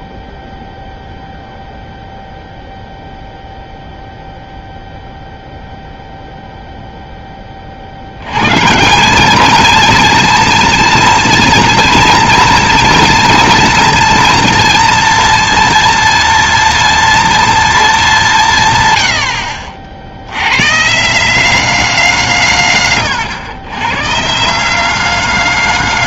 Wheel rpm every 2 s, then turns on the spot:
0, 0, 0, 0, 120, 220, 230, 230, 210, 140, 120, 140, 180.
none